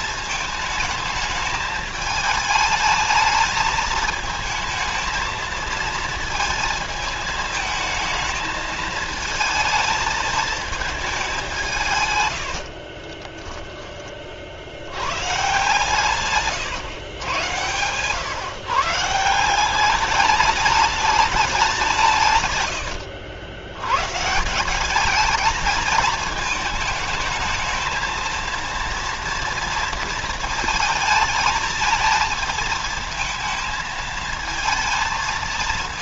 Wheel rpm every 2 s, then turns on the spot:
220, 220, 220, 220, 220, 210, 40, 80, 130, 150, 210, 100, 190, 220, 230, 220, 220, 220.
12-14 22-24